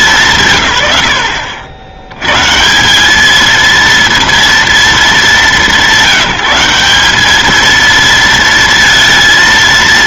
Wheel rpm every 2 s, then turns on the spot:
180, 110, 230, 190, 230.
none